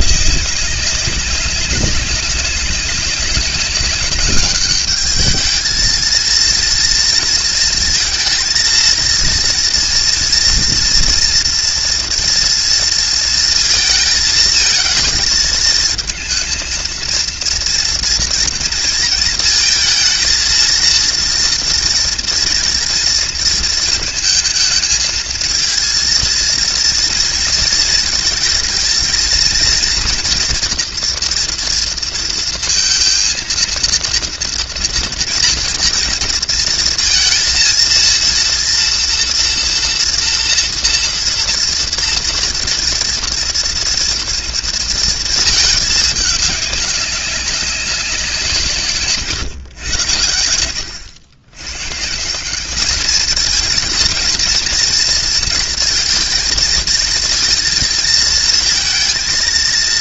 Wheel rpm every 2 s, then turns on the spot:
200, 190, 220, 230, 230, 230, 230, 220, 230, 230, 230, 230, 220, 230, 230, 230, 230, 230, 230, 230, 230, 230, 220, 200, 130, 110, 220, 230, 230, 230.
none